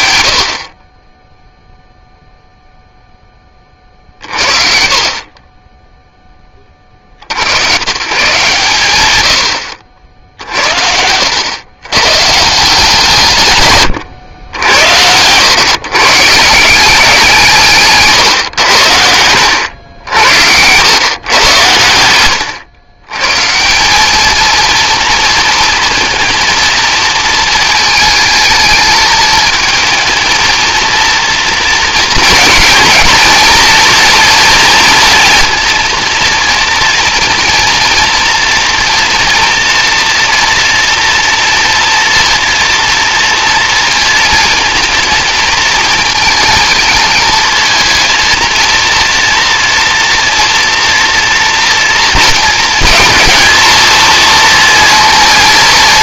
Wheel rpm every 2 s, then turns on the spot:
60, 0, 50, 40, 130, 70, 150, 100, 180, 80, 110, 130, 230, 230, 220, 230, 230, 230, 230, 230, 230, 230, 220, 230, 230, 240, 220, 230.
none